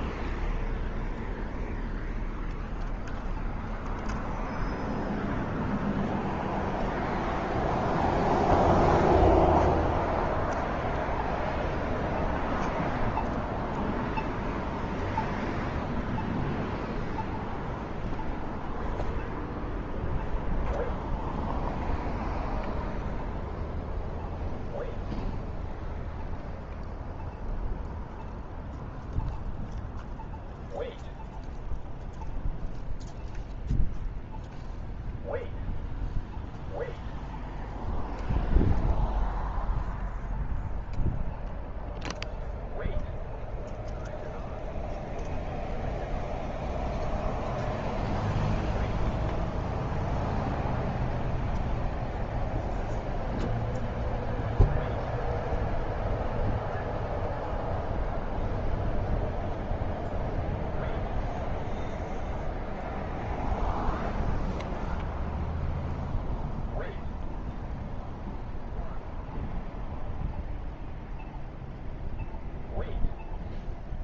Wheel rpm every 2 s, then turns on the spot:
0, 0, 0, 0, 0, 0, 0, 0, 0, 0, 0, 0, 0, 0, 0, 0, 0, 0, 0, 0, 0, 0, 0, 0, 0, 0, 0, 0, 0, 0, 0, 0, 0, 0, 0, 0, 0.
none